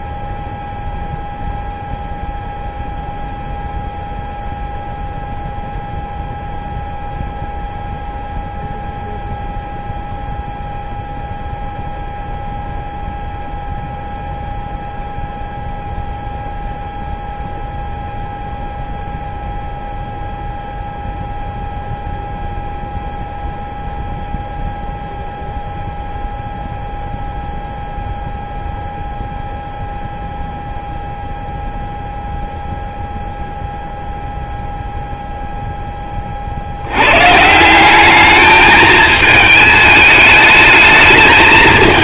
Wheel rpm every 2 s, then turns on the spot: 0, 0, 0, 0, 0, 0, 0, 0, 0, 0, 0, 0, 0, 0, 0, 0, 0, 0, 60, 210, 220.
none